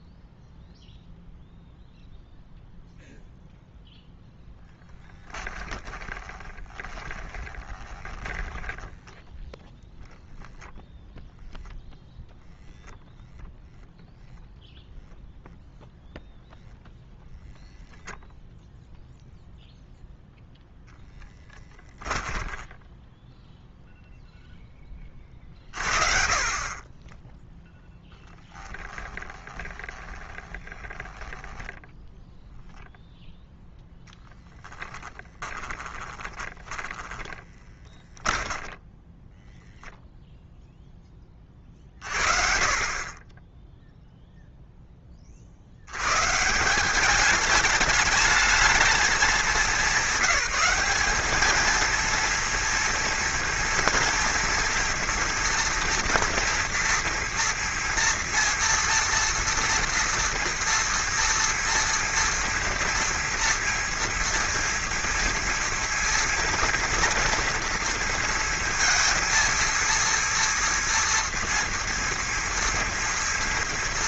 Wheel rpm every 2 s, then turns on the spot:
0, 0, 10, 20, 10, 0, 0, 0, 0, 0, 0, 10, 10, 30, 20, 20, 0, 10, 20, 20, 0, 40, 10, 170, 210, 200, 230, 230, 240, 240, 230, 230, 230, 230, 230, 230, 230.
4-10 22-24 28-32 34-40